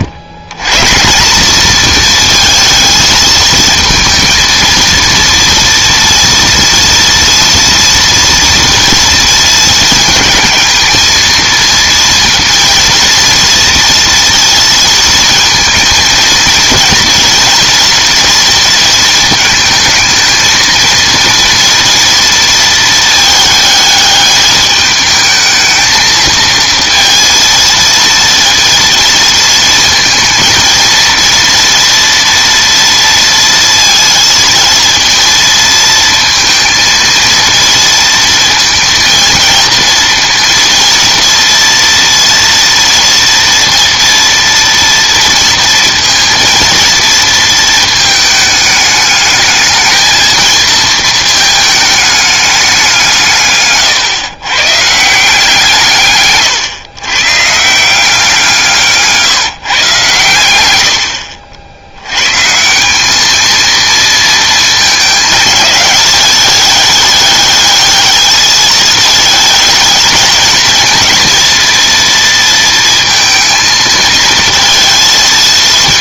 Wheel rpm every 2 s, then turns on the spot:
130, 220, 230, 230, 230, 220, 230, 230, 230, 230, 220, 230, 210, 230, 230, 230, 230, 230, 230, 230, 230, 230, 230, 230, 210, 220, 190, 130, 130, 160, 90, 140, 220, 210, 220, 220, 230, 230.
none